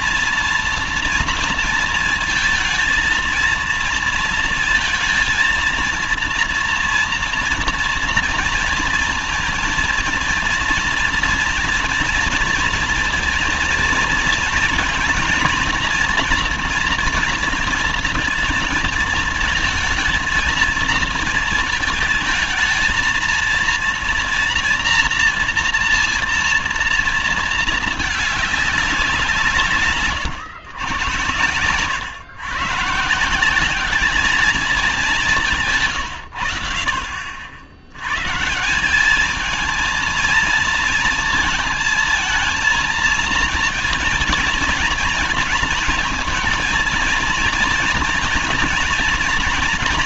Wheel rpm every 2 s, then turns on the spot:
230, 230, 230, 230, 230, 230, 230, 230, 230, 230, 230, 220, 240, 230, 210, 130, 140, 210, 90, 160, 230, 230, 220, 230, 230.
none